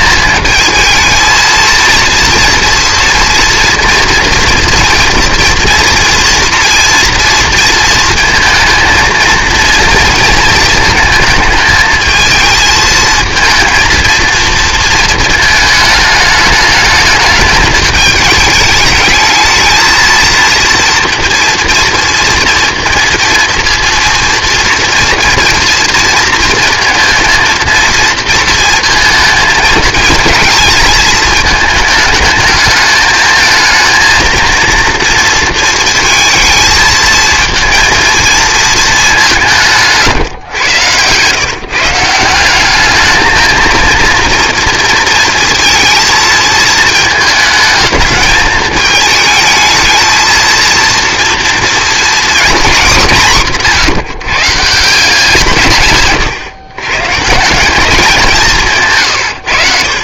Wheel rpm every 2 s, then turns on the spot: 220, 230, 230, 230, 230, 230, 220, 230, 210, 210, 230, 230, 230, 230, 230, 220, 220, 230, 220, 220, 110, 200, 230, 220, 210, 230, 220, 150, 120, 170.
none